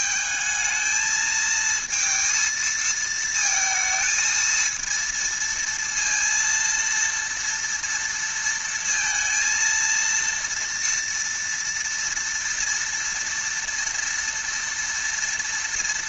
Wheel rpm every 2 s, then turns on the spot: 220, 220, 230, 230, 230, 230, 230, 230.
none